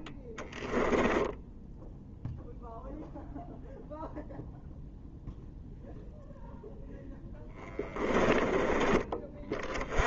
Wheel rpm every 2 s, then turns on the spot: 20, 0, 0, 0, 20.
0-2